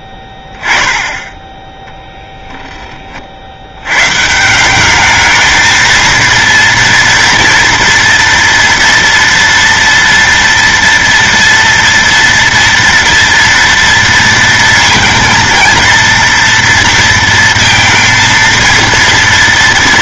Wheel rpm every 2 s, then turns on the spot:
10, 10, 170, 230, 230, 230, 230, 230, 230, 230.
none